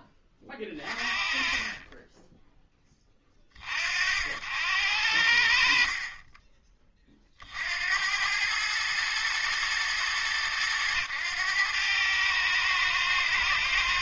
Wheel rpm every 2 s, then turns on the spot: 10, 10, 70, 20, 100, 110, 110.
none